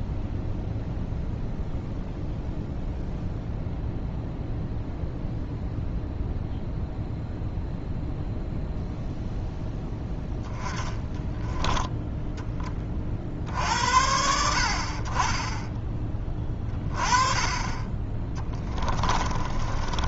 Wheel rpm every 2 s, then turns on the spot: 0, 0, 0, 0, 0, 10, 10, 60, 20, 20.
18-20